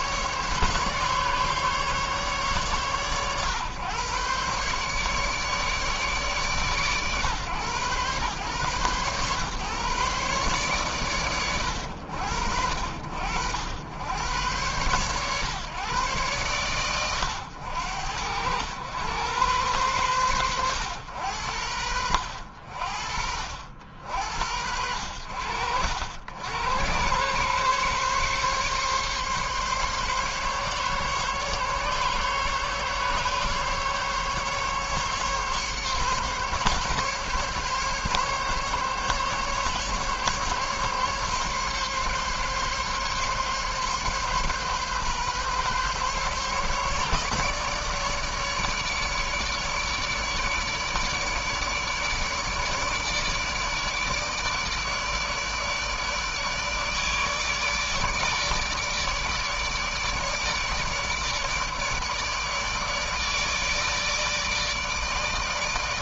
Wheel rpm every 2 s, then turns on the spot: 140, 130, 140, 120, 130, 120, 70, 120, 110, 110, 90, 50, 80, 110, 140, 140, 140, 140, 140, 140, 140, 140, 140, 150, 150, 150, 150, 150, 150, 150, 150, 150, 160.
none